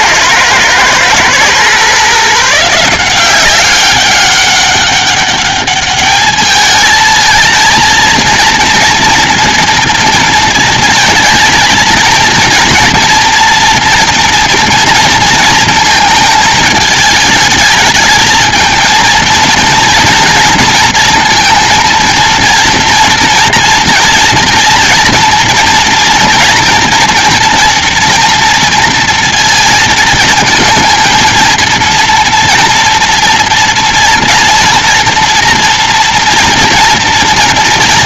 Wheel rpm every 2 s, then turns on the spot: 110, 160, 200, 220, 230, 220, 230, 230, 220, 230, 230, 230, 230, 240, 230, 230, 230, 240, 240.
none